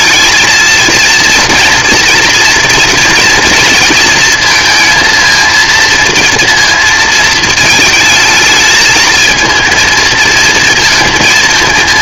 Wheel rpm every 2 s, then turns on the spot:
220, 230, 230, 230, 220, 220.
none